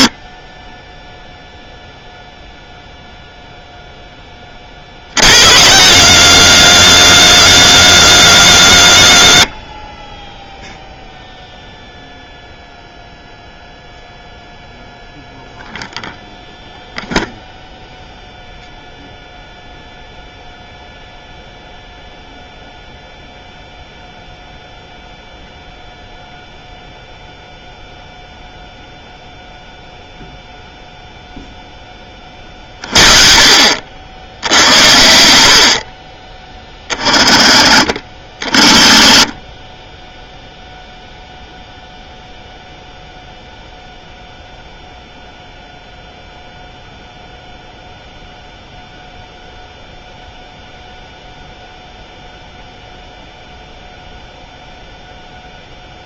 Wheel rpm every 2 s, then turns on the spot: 10, 0, 50, 190, 140, 0, 0, 0, 0, 0, 0, 0, 0, 0, 0, 0, 40, 80, 40, 30, 0, 0, 0, 0, 0, 0, 0, 0.
none